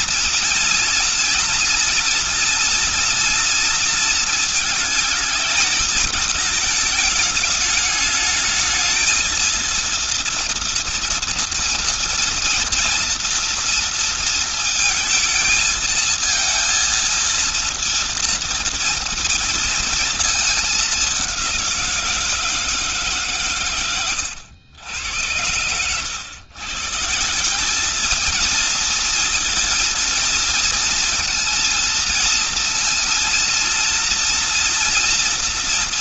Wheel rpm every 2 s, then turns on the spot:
230, 230, 220, 220, 220, 230, 230, 230, 230, 230, 210, 160, 100, 130, 230, 230, 230, 230.
none